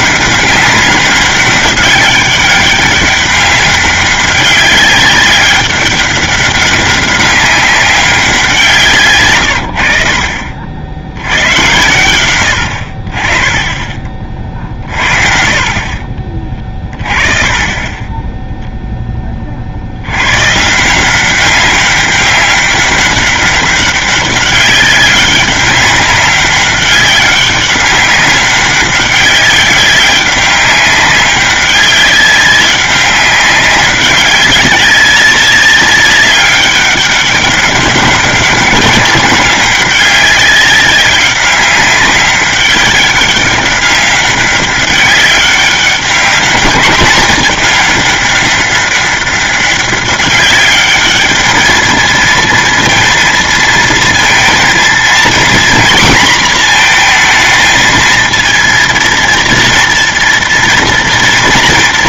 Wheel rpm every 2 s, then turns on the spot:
200, 200, 200, 200, 170, 50, 80, 50, 30, 0, 150, 200, 200, 200, 190, 200, 190, 200, 200, 200, 200, 200, 200, 200, 200, 200, 230, 230, 230, 230, 230.
none